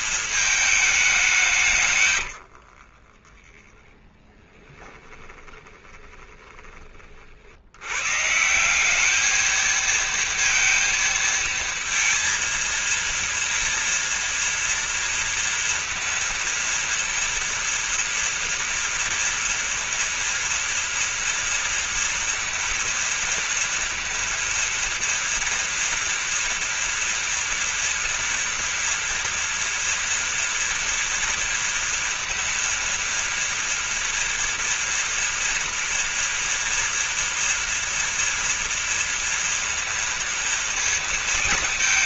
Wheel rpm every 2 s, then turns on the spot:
220, 60, 10, 30, 180, 230, 230, 230, 230, 230, 230, 230, 230, 230, 230, 230, 230, 230, 230, 230, 230.
2-6